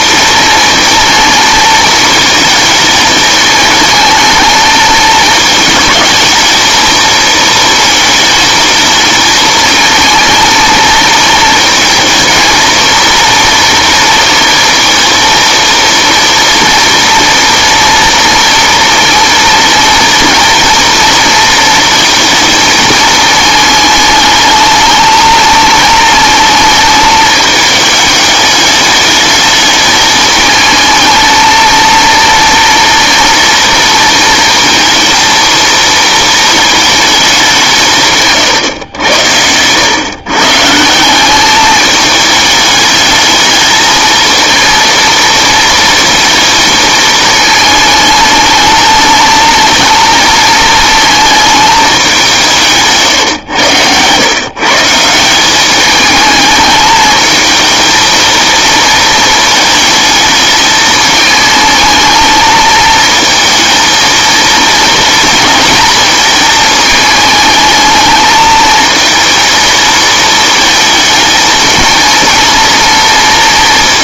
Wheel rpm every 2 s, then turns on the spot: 230, 220, 230, 230, 220, 220, 230, 230, 230, 230, 230, 220, 220, 220, 210, 220, 230, 230, 220, 120, 150, 210, 230, 220, 220, 220, 160, 140, 210, 230, 220, 220, 230, 220, 220, 220, 230.
none